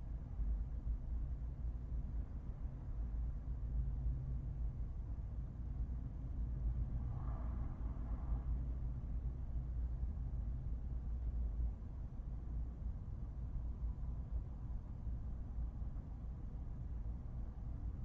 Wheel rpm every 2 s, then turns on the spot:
0, 0, 0, 0, 0, 0, 0, 0, 0.
none